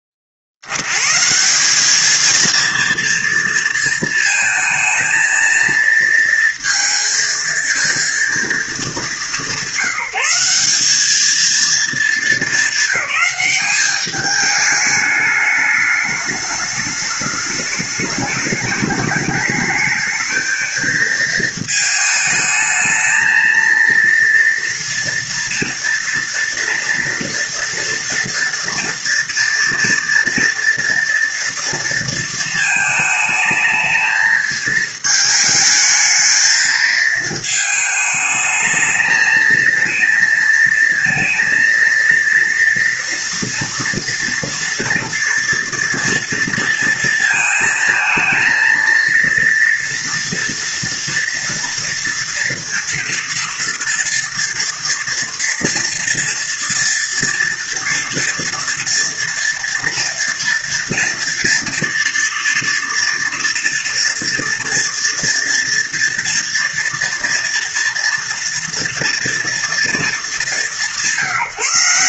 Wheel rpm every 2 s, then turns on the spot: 60, 230, 220, 230, 220, 200, 210, 210, 210, 210, 220, 220, 230, 230, 230, 230, 220, 220, 220, 220, 230, 230, 230, 230, 230, 230, 230, 230, 230, 230, 230, 230, 230, 230, 230, 180.
none